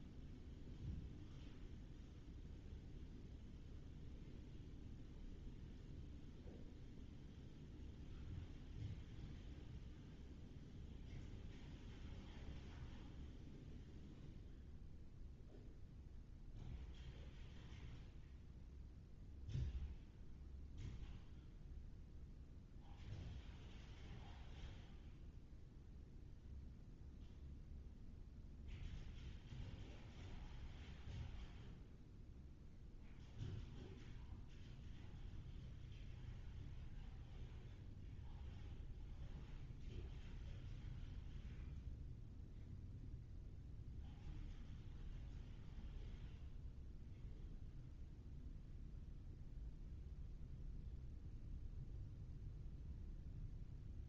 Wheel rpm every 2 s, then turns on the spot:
0, 0, 0, 0, 0, 0, 0, 0, 0, 0, 0, 0, 0, 0, 0, 0, 0, 0, 0, 0, 0, 0, 0, 0, 0, 0, 0.
none